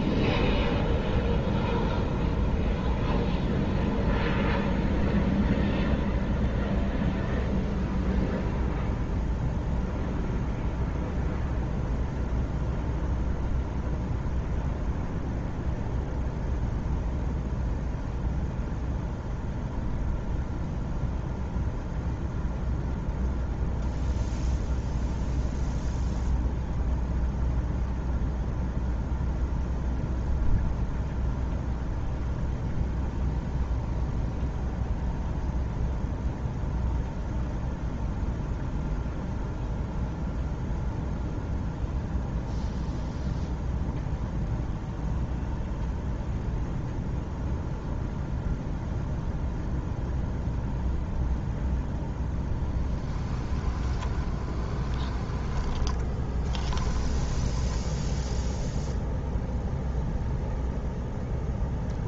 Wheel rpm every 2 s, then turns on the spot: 0, 0, 0, 0, 0, 0, 0, 0, 0, 0, 0, 0, 0, 0, 0, 0, 0, 0, 0, 0, 0, 0, 0, 0, 0, 0, 10, 20, 10, 0, 0.
52-58